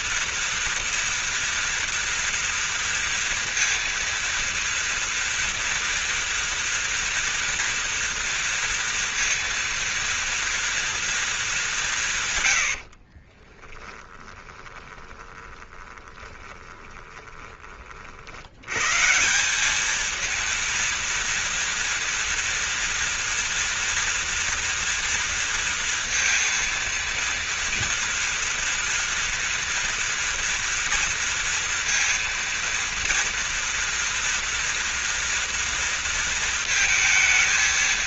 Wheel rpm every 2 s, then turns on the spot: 230, 230, 230, 230, 230, 230, 120, 20, 20, 70, 230, 230, 230, 230, 230, 240, 230, 230, 230.
14-18